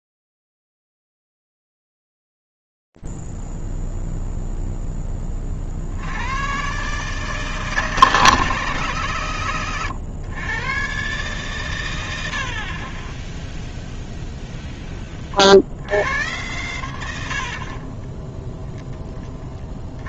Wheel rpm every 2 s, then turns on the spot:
0, 0, 0, 80, 160, 120, 80, 0, 100, 10.
none